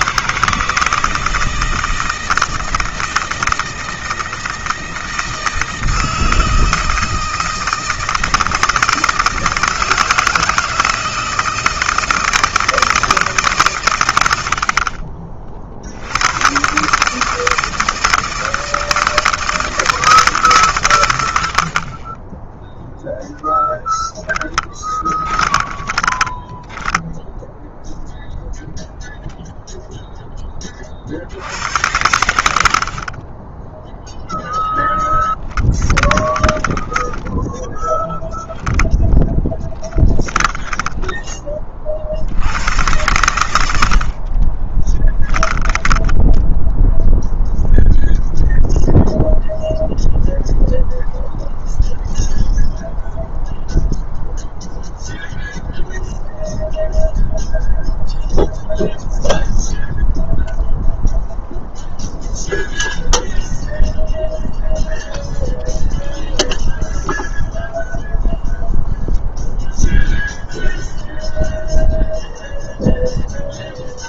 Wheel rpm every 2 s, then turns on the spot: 160, 160, 160, 160, 160, 160, 160, 50, 140, 170, 100, 0, 20, 10, 10, 40, 40, 10, 10, 10, 20, 110, 20, 0, 0, 0, 0, 0, 0, 0, 0, 0, 0, 0, 0, 0, 0.
24-28 32-34 38-42 44-46